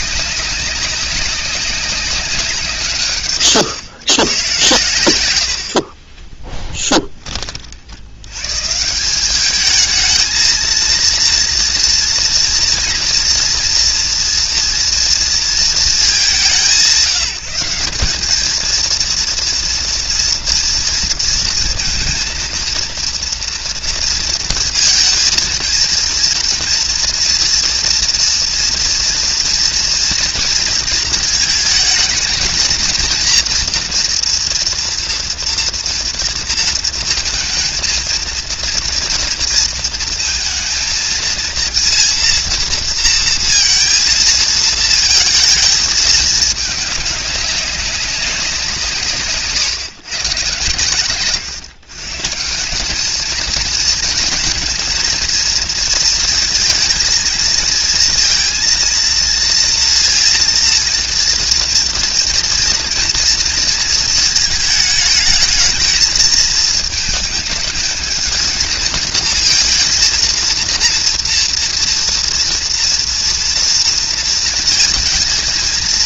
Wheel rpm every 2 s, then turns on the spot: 200, 160, 130, 10, 130, 220, 240, 240, 180, 210, 230, 230, 230, 230, 230, 230, 230, 240, 230, 230, 230, 230, 220, 210, 180, 120, 180, 220, 230, 230, 230, 230, 220, 220, 230, 230, 230, 230.
6-8